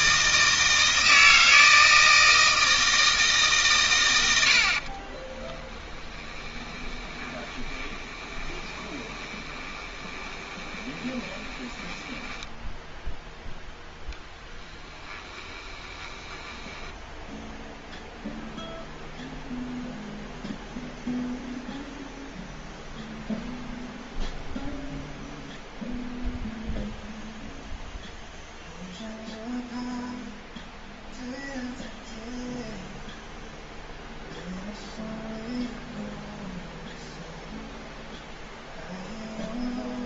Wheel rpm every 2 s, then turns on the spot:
160, 160, 60, 20, 20, 20, 0, 20, 10, 0, 0, 0, 0, 0, 0, 0, 0, 0, 0, 0.
4-12 14-18